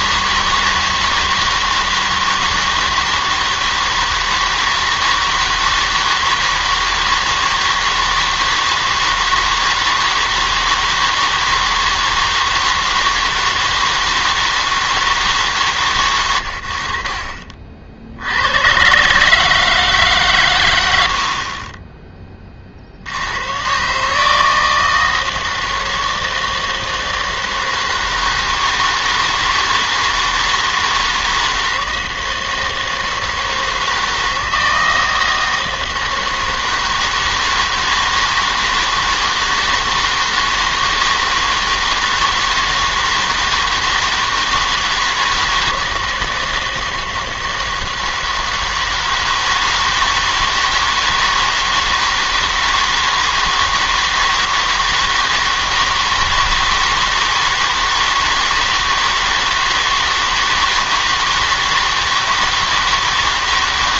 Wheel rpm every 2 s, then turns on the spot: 160, 160, 160, 160, 160, 160, 160, 160, 70, 100, 110, 40, 160, 160, 160, 160, 160, 160, 160, 160, 160, 160, 160, 160, 160, 160, 160, 160, 160, 160, 160, 160.
none